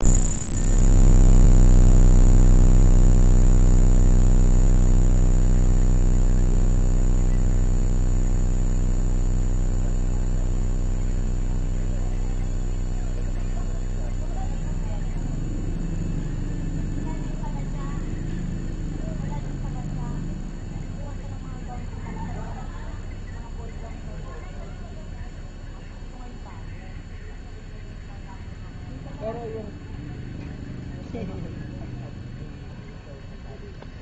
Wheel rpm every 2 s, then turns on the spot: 0, 0, 0, 0, 0, 0, 0, 0, 0, 0, 0, 0, 0, 0, 0, 0, 0.
none